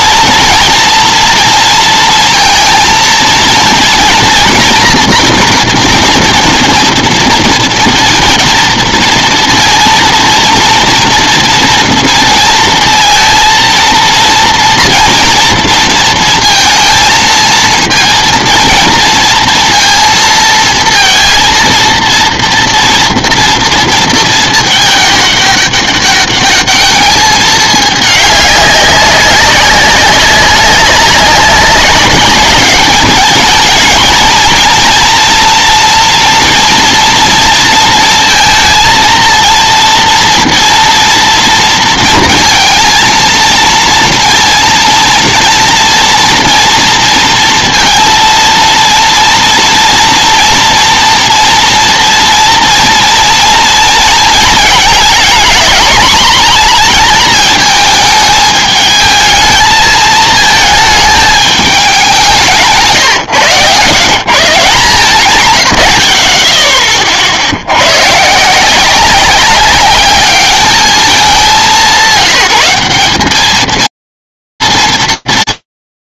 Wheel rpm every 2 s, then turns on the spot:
230, 230, 230, 230, 230, 230, 230, 230, 230, 230, 230, 230, 220, 200, 210, 200, 200, 220, 240, 230, 230, 230, 230, 230, 230, 240, 230, 230, 220, 220, 220, 190, 150, 50, 130, 200, 200, 160.
none